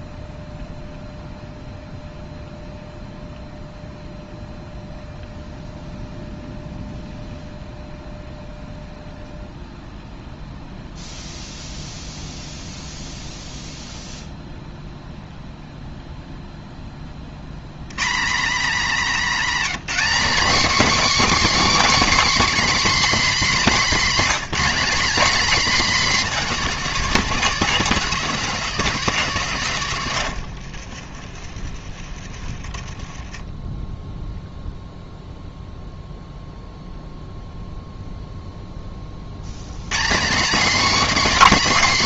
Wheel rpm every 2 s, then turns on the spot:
0, 0, 0, 0, 0, 0, 0, 0, 0, 230, 280, 310, 210, 250, 250, 120, 50, 0, 0, 0, 250.
none